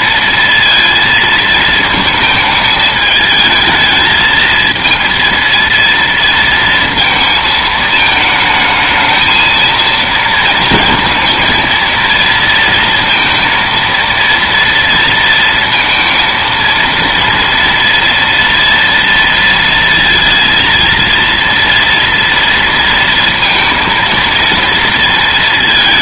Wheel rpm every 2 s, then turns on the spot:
230, 220, 220, 230, 220, 230, 230, 230, 230, 230, 230, 230, 230.
none